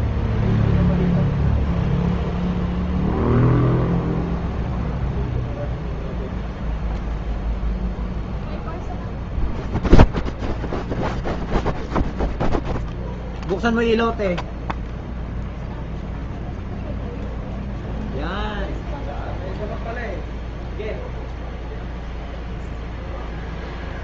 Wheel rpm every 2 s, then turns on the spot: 0, 0, 0, 0, 0, 0, 0, 0, 0, 0, 0, 0.
none